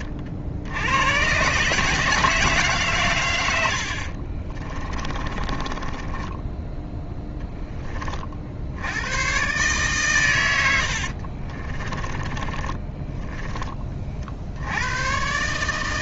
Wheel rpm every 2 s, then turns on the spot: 80, 130, 30, 0, 80, 80, 30, 100.
4-6 12-14